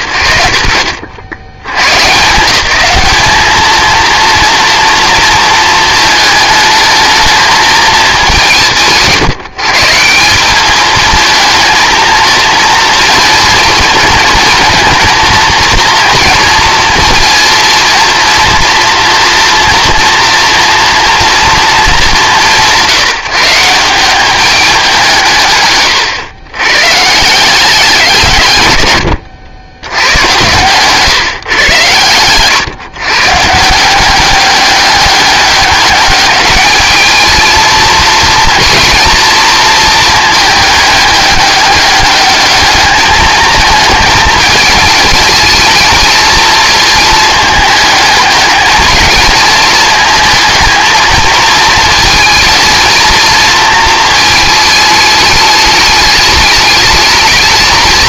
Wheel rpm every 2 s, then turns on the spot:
90, 200, 230, 220, 150, 210, 230, 230, 230, 230, 230, 150, 180, 130, 110, 130, 130, 200, 220, 230, 210, 210, 220, 220, 210, 220, 230, 220, 220.
none